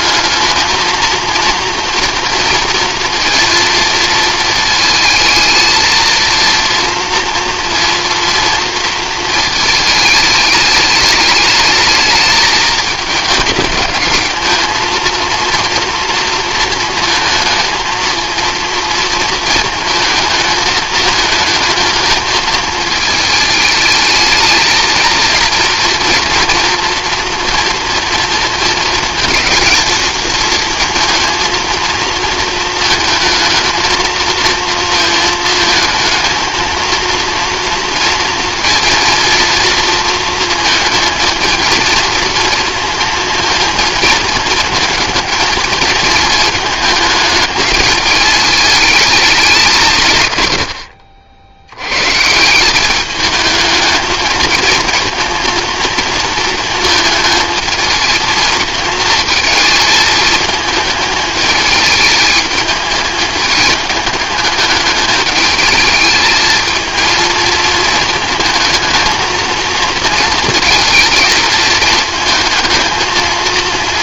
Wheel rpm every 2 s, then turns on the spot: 220, 230, 220, 230, 230, 210, 210, 220, 230, 230, 220, 220, 220, 240, 230, 230, 230, 220, 220, 230, 230, 230, 230, 220, 210, 100, 180, 220, 230, 220, 220, 220, 210, 220, 220, 220, 220.
none